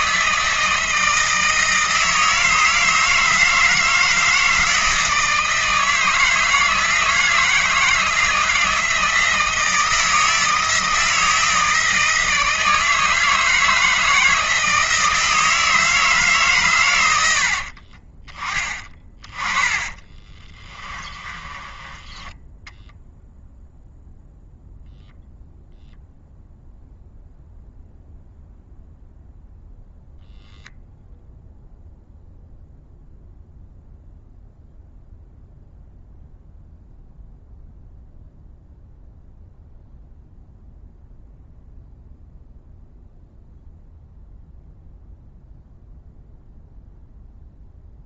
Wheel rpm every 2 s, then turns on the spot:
160, 160, 160, 160, 160, 160, 160, 160, 100, 30, 30, 0, 0, 0, 0, 0, 0, 0, 0, 0, 0, 0, 0, 0.
18-22